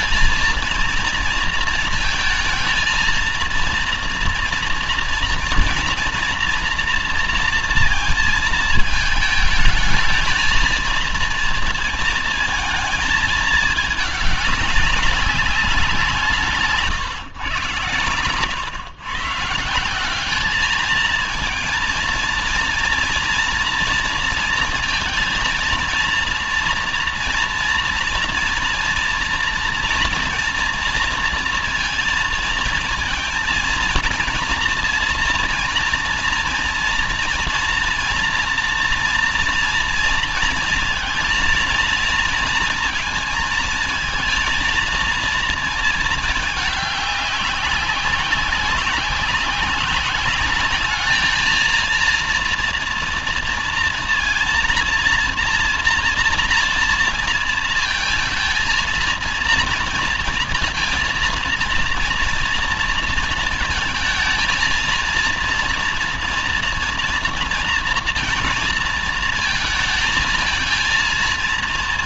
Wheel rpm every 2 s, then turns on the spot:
230, 230, 230, 230, 220, 230, 220, 200, 130, 140, 220, 230, 230, 230, 230, 230, 220, 230, 240, 240, 230, 230, 230, 200, 190, 220, 240, 230, 230, 230, 230, 230, 230, 230, 220, 230.
none